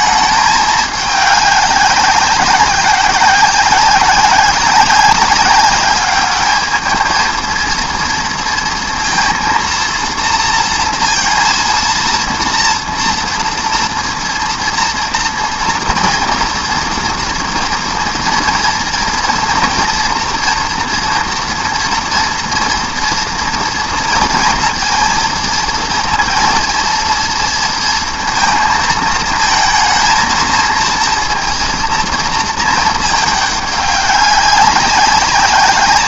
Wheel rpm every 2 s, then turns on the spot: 210, 200, 190, 210, 230, 230, 230, 230, 230, 230, 230, 240, 230, 230, 220, 230, 220, 190.
none